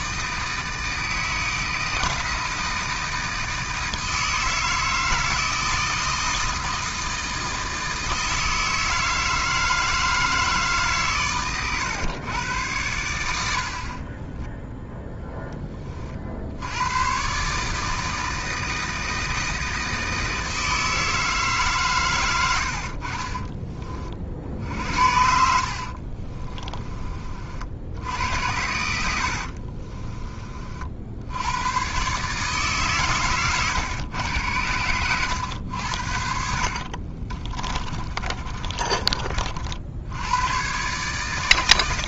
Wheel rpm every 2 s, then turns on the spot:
160, 160, 160, 160, 160, 140, 100, 20, 110, 160, 160, 70, 70, 20, 80, 60, 140, 100, 50, 30, 130.
14-16 22-24 28-30 34-40